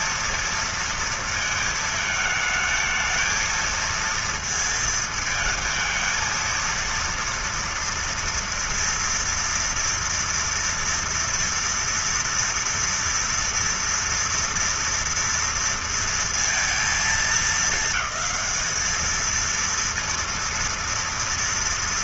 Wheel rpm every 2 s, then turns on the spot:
230, 220, 230, 230, 230, 230, 230, 230, 230, 220, 230.
none